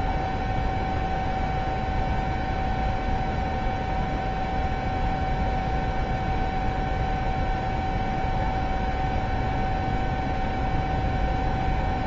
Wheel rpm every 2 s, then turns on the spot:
0, 0, 0, 0, 0, 0.
none